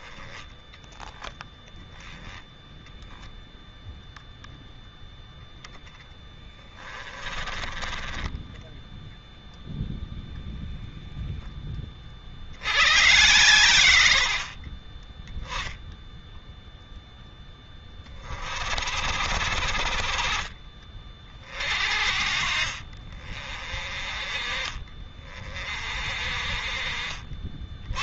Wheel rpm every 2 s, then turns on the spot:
20, 0, 0, 20, 10, 0, 60, 50, 0, 40, 30, 40, 30, 40.
6-10